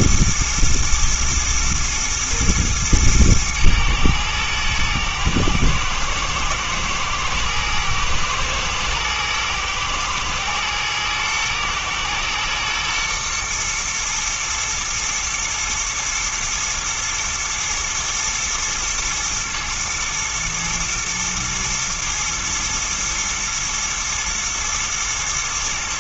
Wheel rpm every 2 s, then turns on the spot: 110, 110, 110, 110, 120, 110, 110, 120, 110, 110, 110, 120, 110.
none